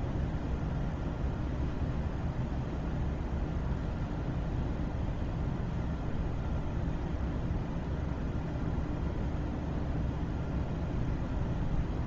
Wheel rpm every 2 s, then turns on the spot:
0, 0, 0, 0, 0, 0.
none